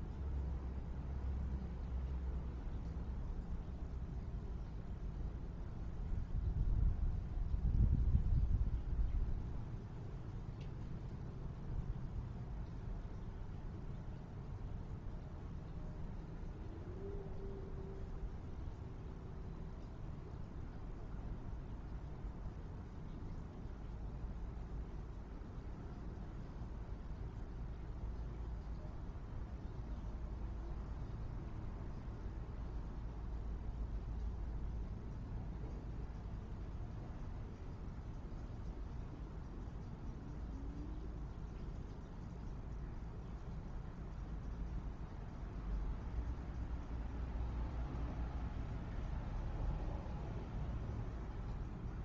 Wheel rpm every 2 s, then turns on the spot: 0, 0, 0, 0, 0, 0, 0, 0, 0, 0, 0, 0, 0, 0, 0, 0, 0, 0, 0, 0, 0, 0, 0, 0, 0, 0.
none